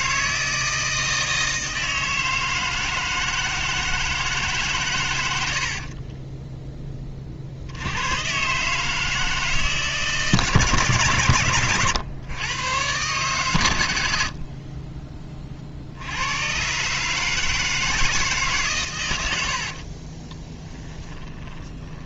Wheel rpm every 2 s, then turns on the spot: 160, 160, 130, 10, 150, 140, 120, 30, 140, 120, 30.
14-16 20-22